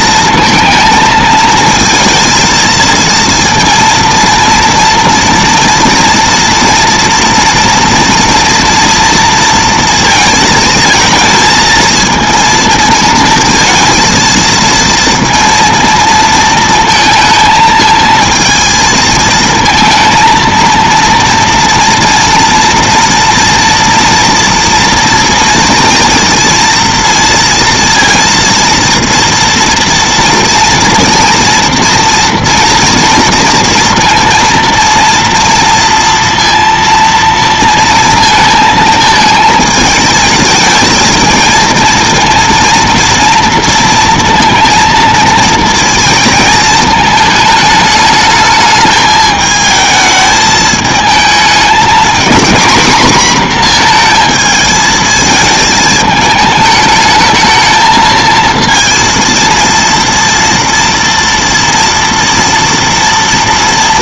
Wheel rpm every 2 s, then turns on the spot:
230, 230, 230, 230, 230, 220, 230, 230, 230, 220, 230, 230, 230, 230, 230, 230, 230, 230, 230, 230, 220, 230, 230, 220, 220, 220, 240, 220, 220, 230, 230, 230.
none